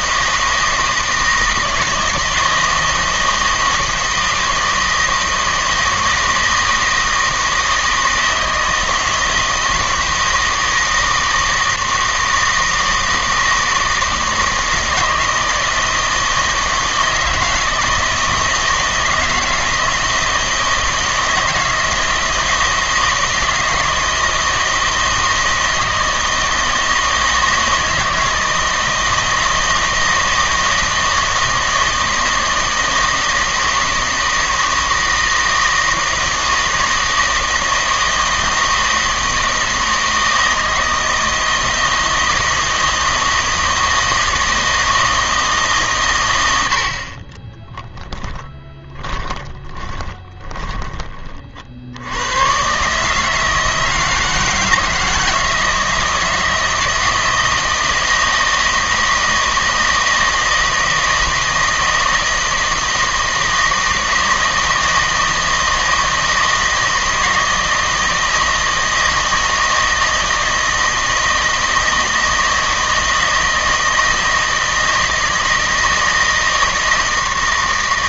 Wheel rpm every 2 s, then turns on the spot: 160, 160, 160, 160, 160, 160, 160, 160, 160, 160, 160, 160, 160, 160, 160, 160, 160, 160, 160, 160, 160, 160, 160, 70, 20, 30, 130, 160, 160, 160, 160, 160, 160, 160, 160, 160, 160, 160, 160.
48-50